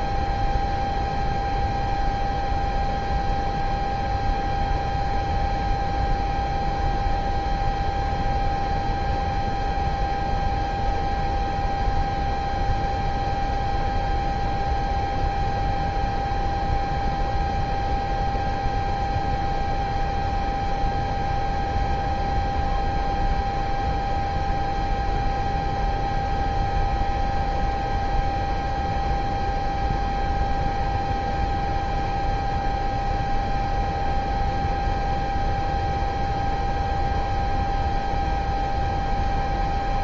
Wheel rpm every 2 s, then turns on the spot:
0, 0, 0, 0, 0, 0, 0, 0, 0, 0, 0, 0, 0, 0, 0, 0, 0, 0, 0, 0.
none